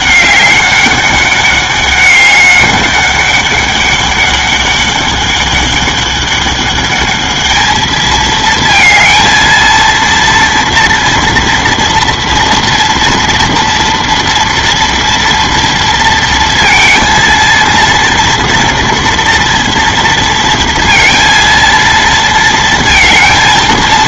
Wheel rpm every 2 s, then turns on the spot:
200, 200, 200, 200, 220, 230, 230, 230, 230, 230, 230, 230.
none